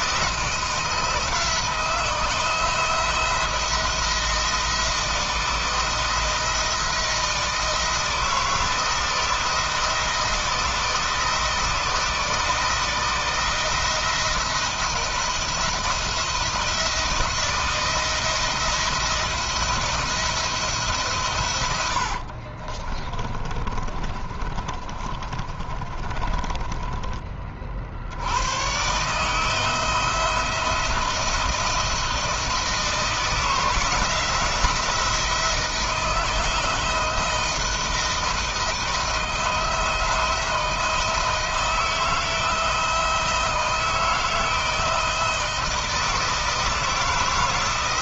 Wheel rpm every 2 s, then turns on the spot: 170, 160, 170, 170, 160, 160, 160, 170, 170, 170, 150, 40, 30, 30, 120, 170, 170, 170, 160, 160, 170, 160, 160, 170.
22-28